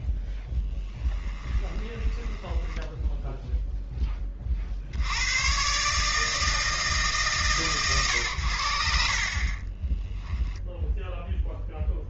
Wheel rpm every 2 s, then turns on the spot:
10, 10, 30, 160, 80, 0.
0-4